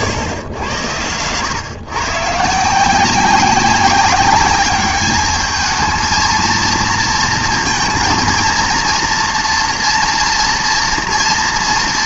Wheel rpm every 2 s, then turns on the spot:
100, 170, 200, 230, 230, 230.
none